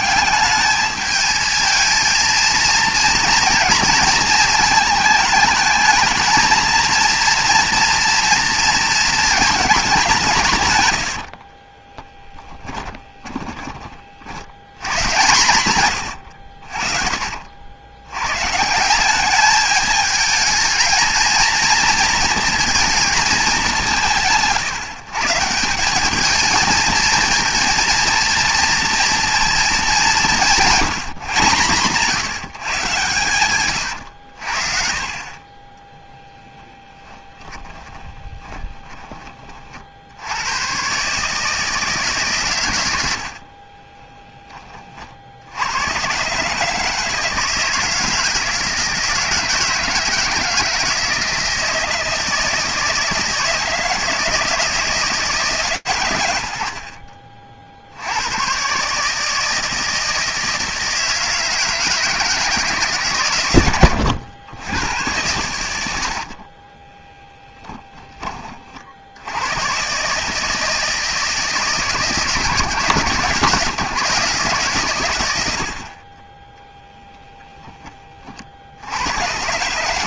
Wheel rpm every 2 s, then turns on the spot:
210, 230, 230, 230, 230, 150, 20, 100, 50, 150, 220, 220, 150, 220, 230, 180, 150, 60, 10, 20, 100, 120, 20, 140, 160, 160, 160, 160, 100, 120, 160, 160, 100, 40, 50, 160, 150, 130, 0, 70.
12-14 38-40 66-68